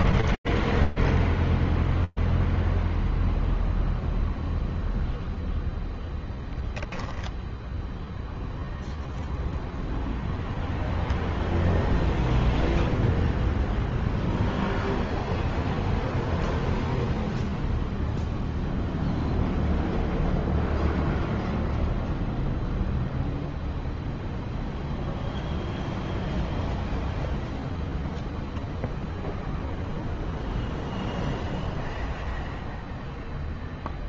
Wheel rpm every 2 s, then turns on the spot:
0, 0, 0, 0, 0, 0, 0, 0, 0, 0, 0, 0, 0, 0, 0, 0, 0.
none